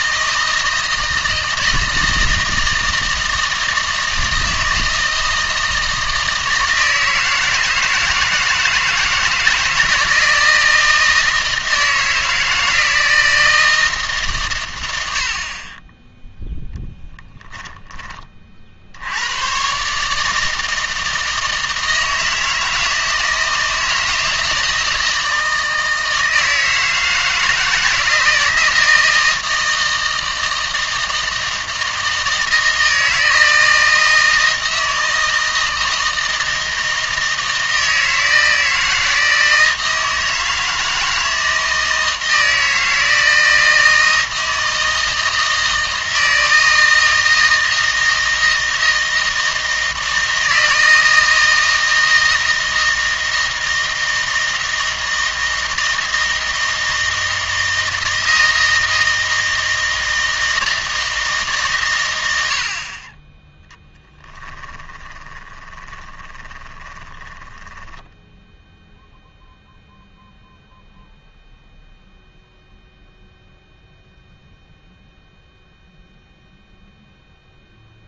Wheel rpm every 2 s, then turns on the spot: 160, 160, 160, 160, 160, 160, 160, 110, 0, 50, 160, 160, 160, 160, 160, 160, 160, 160, 160, 160, 160, 160, 160, 160, 160, 160, 160, 160, 160, 160, 160, 50, 10, 20, 0, 0, 0, 0, 0.
64-68